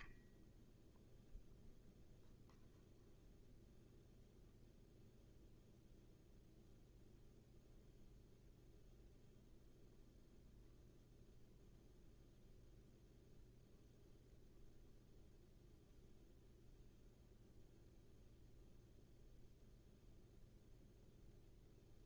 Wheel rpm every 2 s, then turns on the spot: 0, 0, 0, 0, 0, 0, 0, 0, 0, 0, 0.
none